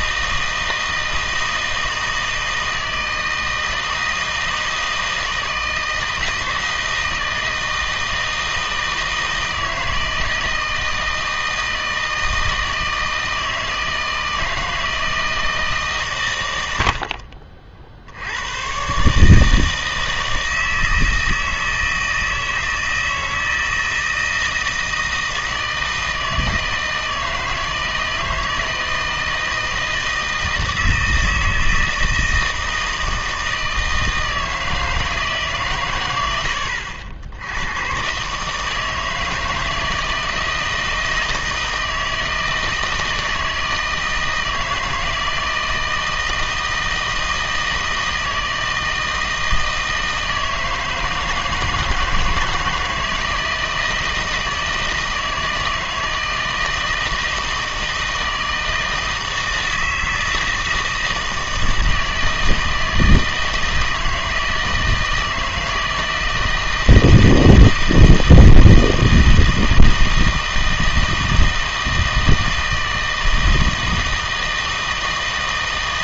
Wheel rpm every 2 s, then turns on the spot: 160, 160, 160, 160, 160, 160, 160, 160, 80, 120, 160, 160, 160, 160, 160, 160, 160, 160, 80, 160, 160, 160, 160, 160, 160, 160, 160, 160, 160, 160, 160, 160, 160, 160, 160, 160, 160, 160.
none